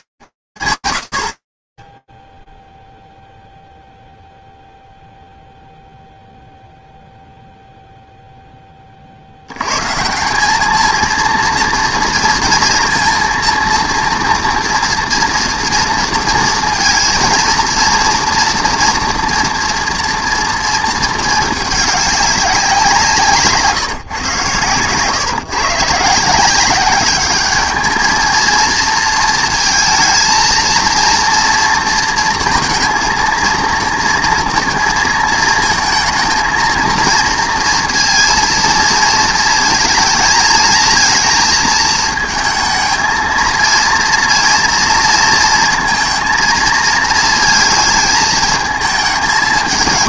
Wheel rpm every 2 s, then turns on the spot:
80, 0, 0, 0, 50, 220, 230, 230, 230, 230, 220, 170, 130, 200, 230, 230, 230, 230, 230, 230, 220, 220, 230, 230, 200.
none